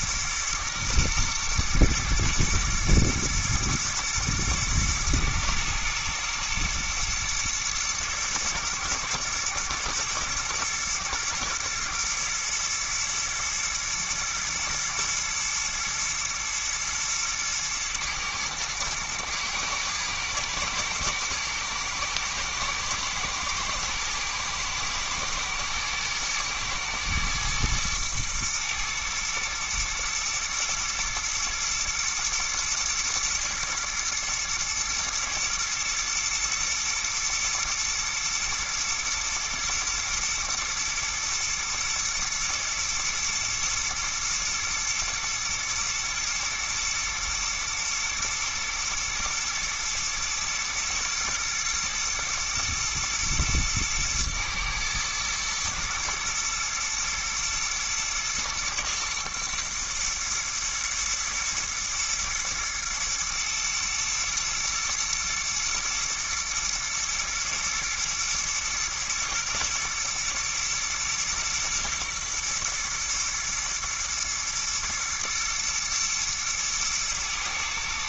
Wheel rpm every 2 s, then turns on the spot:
120, 110, 120, 120, 120, 120, 110, 110, 120, 110, 110, 110, 110, 110, 110, 120, 120, 110, 110, 110, 120, 120, 110, 110, 110, 120, 120, 110, 110, 110, 120, 120, 110, 110, 120, 110, 110, 120, 110.
none